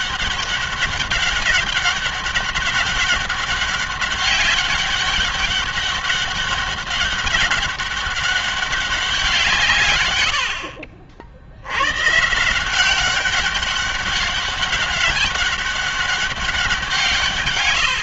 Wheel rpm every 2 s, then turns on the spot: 200, 200, 200, 200, 190, 60, 180, 200, 180.
none